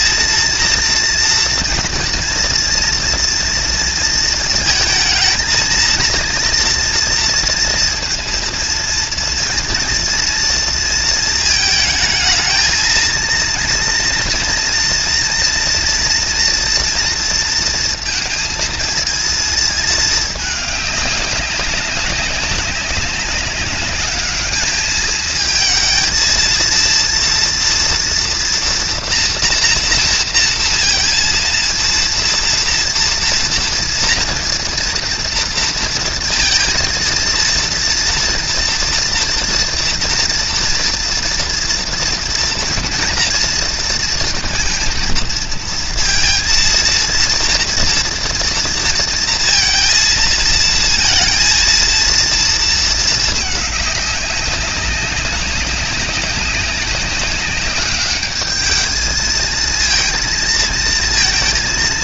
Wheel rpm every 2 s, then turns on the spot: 230, 230, 230, 230, 230, 230, 220, 230, 240, 220, 210, 190, 210, 230, 240, 230, 230, 230, 230, 230, 230, 230, 230, 230, 230, 230, 230, 200, 190, 210, 220.
none